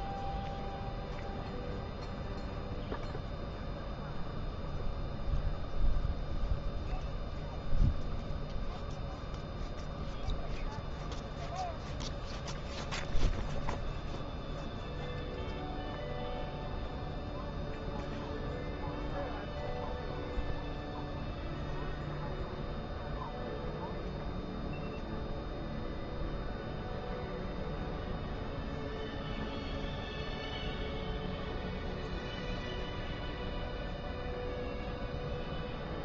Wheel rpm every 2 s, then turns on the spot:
0, 0, 0, 0, 0, 0, 0, 0, 0, 0, 0, 0, 0, 0, 0, 0, 0, 0.
none